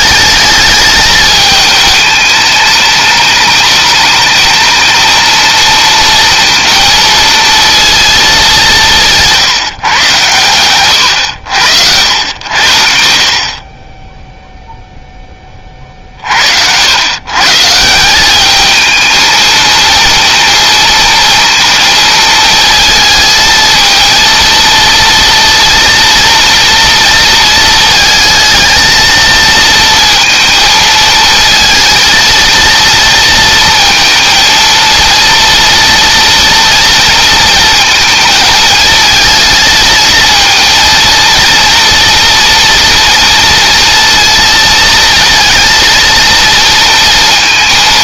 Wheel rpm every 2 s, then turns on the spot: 220, 210, 220, 230, 170, 110, 70, 0, 100, 220, 230, 220, 230, 230, 220, 220, 230, 230, 230, 220, 230, 230, 230, 230.
none